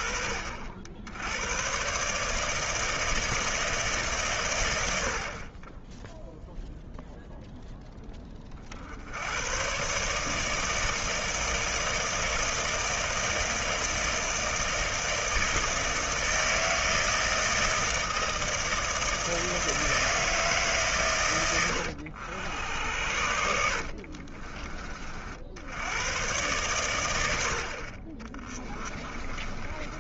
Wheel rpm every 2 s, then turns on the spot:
70, 160, 80, 0, 60, 160, 160, 160, 160, 160, 140, 80, 40, 110, 20.
28-30